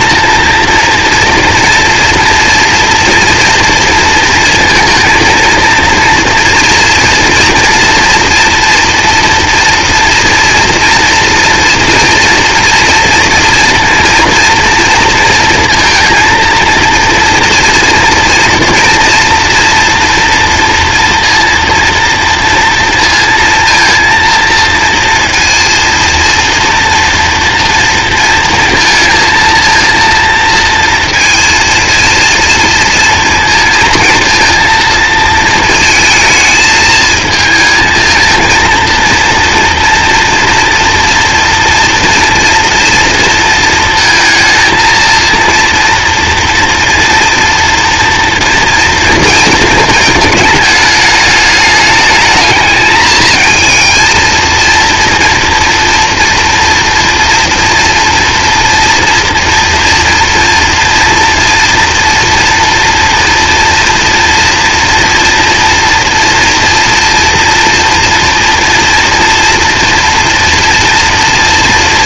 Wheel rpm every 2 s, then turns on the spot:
240, 230, 230, 230, 230, 230, 230, 230, 230, 230, 240, 230, 230, 230, 230, 230, 230, 230, 220, 230, 230, 230, 230, 240, 240, 220, 220, 230, 230, 230, 230, 230, 230, 230, 230, 230.
none